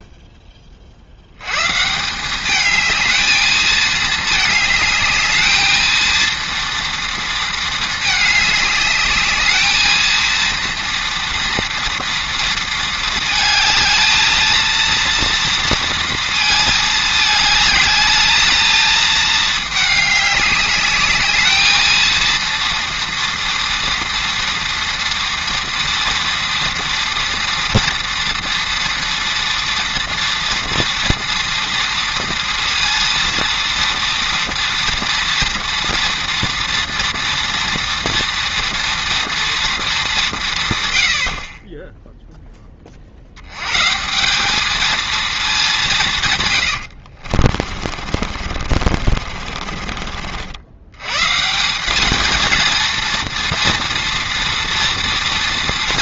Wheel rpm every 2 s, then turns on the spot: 20, 210, 220, 230, 210, 230, 230, 230, 220, 220, 210, 230, 230, 230, 230, 230, 230, 240, 230, 230, 140, 20, 200, 110, 50, 80, 230, 230.
46-50